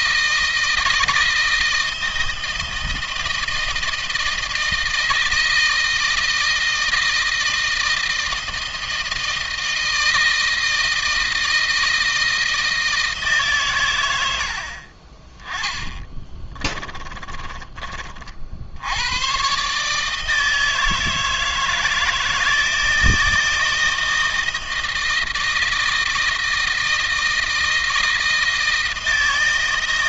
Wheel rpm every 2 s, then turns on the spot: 160, 160, 160, 160, 160, 160, 160, 50, 20, 90, 160, 160, 160, 160, 160.
14-18